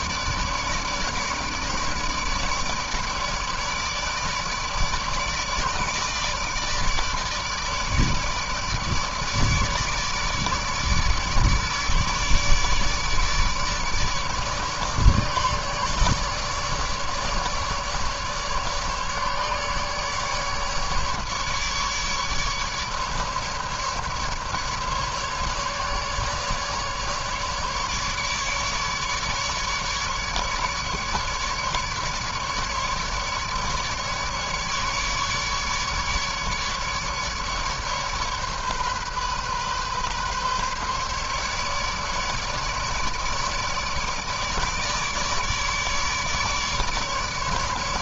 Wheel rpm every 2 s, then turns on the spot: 150, 150, 150, 150, 150, 150, 150, 150, 150, 150, 150, 150, 150, 150, 150, 150, 150, 150, 150, 140, 140, 150, 150, 150.
none